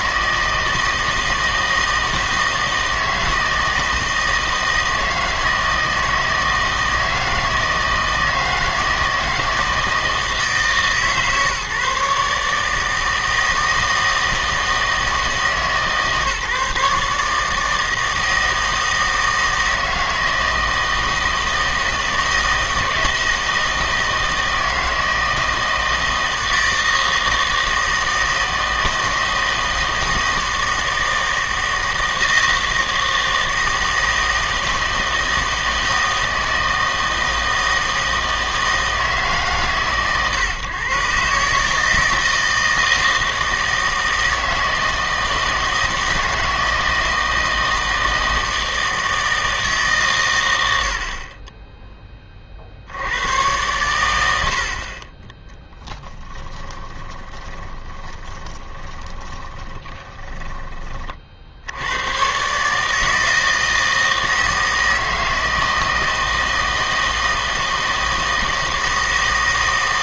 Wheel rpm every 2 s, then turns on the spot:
160, 160, 160, 160, 160, 150, 150, 160, 150, 160, 160, 160, 160, 160, 160, 160, 160, 160, 160, 160, 130, 160, 160, 160, 160, 90, 50, 60, 20, 20, 20, 150, 160, 160, 160.
56-60